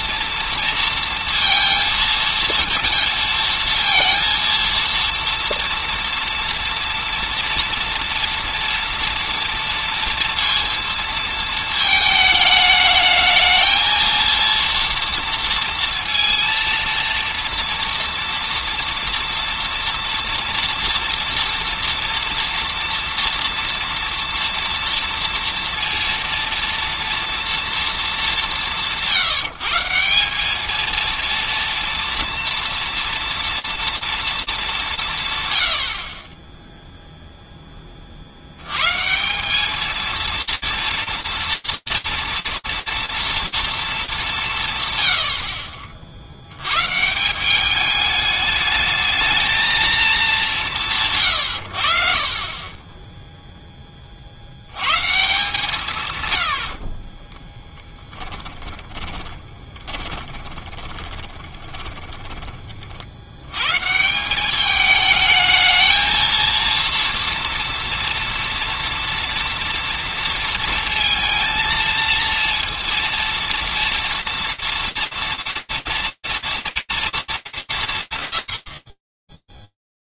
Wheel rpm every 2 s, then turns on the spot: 230, 230, 230, 230, 230, 230, 210, 230, 230, 230, 230, 230, 240, 230, 170, 220, 230, 170, 0, 120, 230, 230, 130, 130, 220, 150, 10, 160, 40, 20, 20, 100, 220, 230, 230, 230, 230, 230, 230, 90.
52-54 56-62